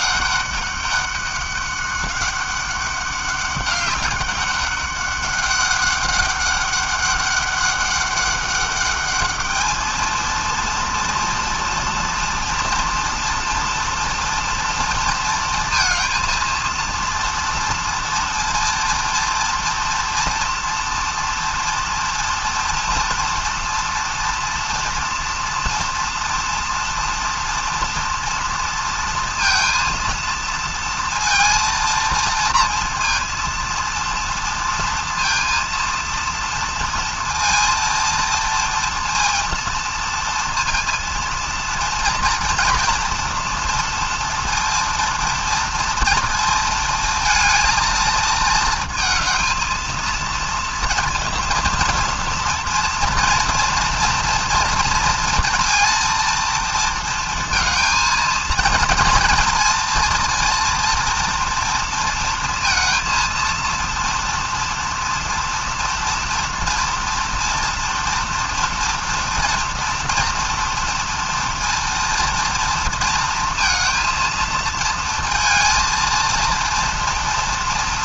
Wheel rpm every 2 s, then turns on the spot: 200, 200, 200, 200, 200, 230, 230, 230, 230, 240, 230, 230, 230, 230, 230, 230, 230, 230, 230, 230, 230, 230, 230, 220, 220, 230, 230, 230, 230, 220, 230, 230, 230, 240, 230, 230, 230, 230, 230.
none